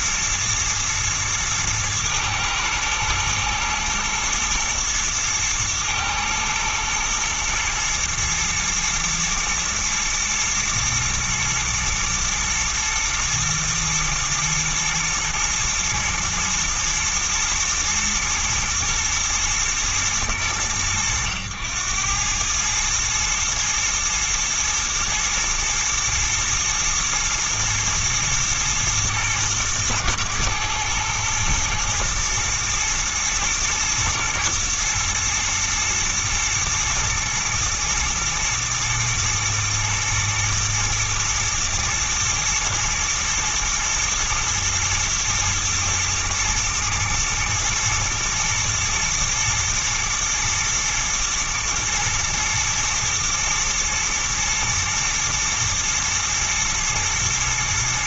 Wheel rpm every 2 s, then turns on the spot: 120, 110, 120, 110, 110, 120, 110, 110, 110, 110, 100, 100, 110, 120, 110, 110, 120, 120, 120, 110, 110, 120, 110, 110, 110, 120, 120, 120, 120.
none